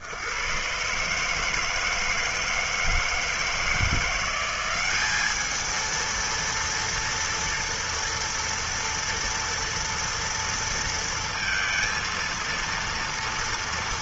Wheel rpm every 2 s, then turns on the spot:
70, 160, 170, 230, 230, 230, 230.
none